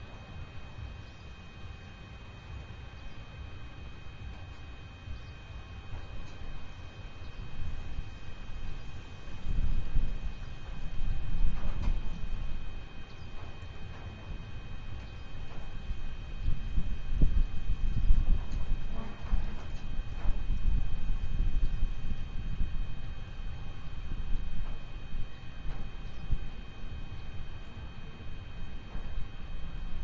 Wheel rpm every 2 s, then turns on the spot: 0, 0, 0, 0, 0, 0, 0, 0, 0, 0, 0, 0, 0, 0, 0.
none